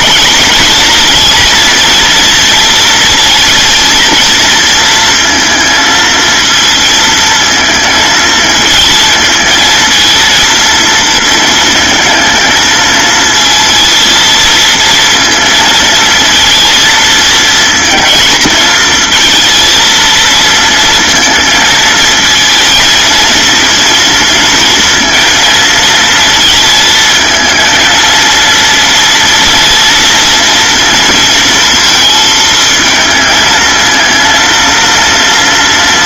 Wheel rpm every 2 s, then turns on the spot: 230, 230, 230, 220, 220, 230, 220, 230, 230, 220, 230, 230, 230, 230, 230, 230, 220, 230.
none